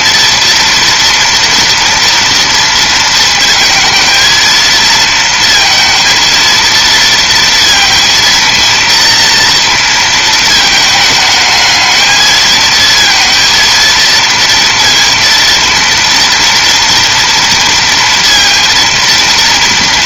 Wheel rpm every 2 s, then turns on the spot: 230, 230, 230, 230, 230, 220, 220, 230, 230, 230.
none